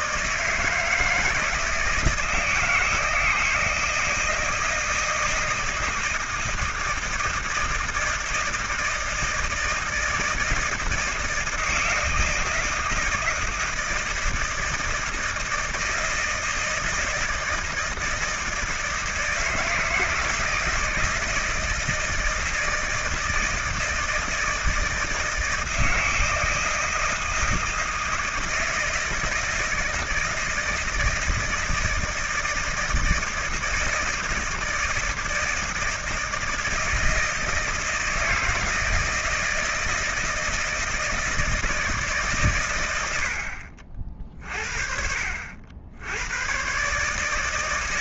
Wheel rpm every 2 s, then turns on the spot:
160, 160, 160, 160, 160, 160, 160, 160, 160, 160, 160, 160, 160, 160, 160, 170, 160, 160, 160, 170, 160, 100, 50, 130.
none